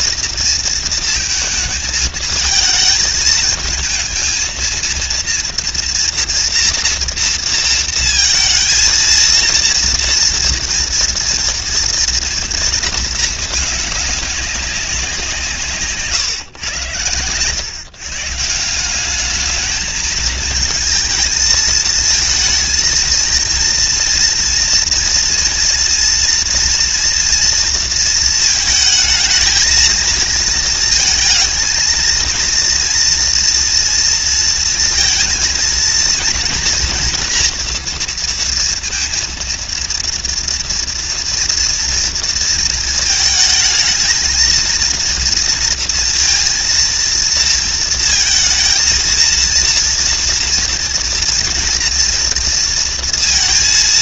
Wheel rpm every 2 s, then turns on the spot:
230, 220, 230, 230, 230, 230, 220, 180, 110, 210, 220, 230, 230, 230, 220, 230, 230, 230, 240, 230, 230, 220, 230, 230, 230, 230, 230.
none